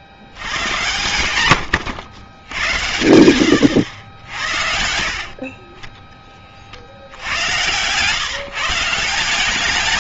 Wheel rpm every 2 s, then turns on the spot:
110, 90, 60, 60, 160.
none